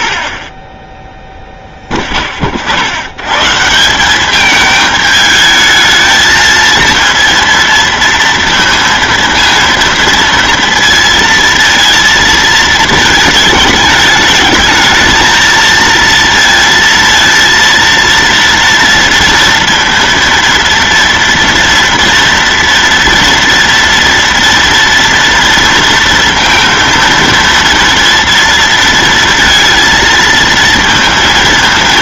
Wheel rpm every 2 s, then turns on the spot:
10, 60, 220, 230, 230, 230, 220, 210, 230, 230, 230, 230, 230, 230, 230, 230.
none